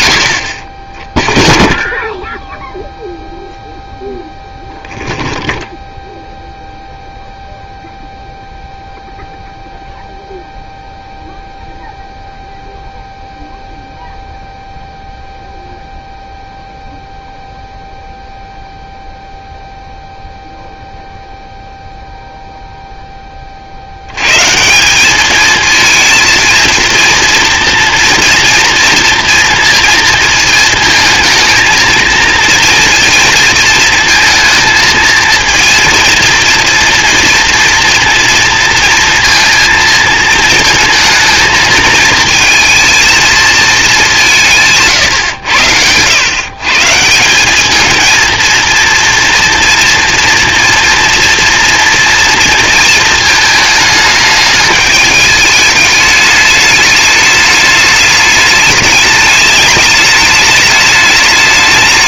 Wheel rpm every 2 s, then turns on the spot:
20, 0, 0, 0, 0, 0, 0, 0, 0, 0, 0, 0, 170, 230, 230, 230, 230, 220, 230, 230, 230, 230, 150, 150, 230, 230, 230, 210, 210, 210, 210.
none